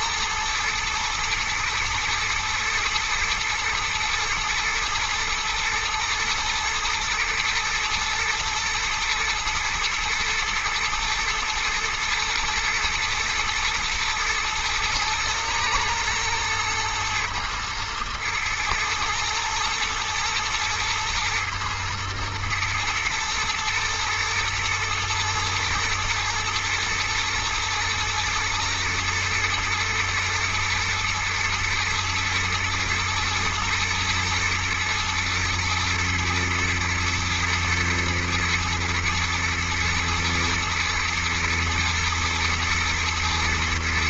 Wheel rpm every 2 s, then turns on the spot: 120, 120, 110, 110, 110, 110, 110, 110, 110, 120, 110, 110, 110, 120, 110, 110, 120, 110, 110, 110, 120, 120.
none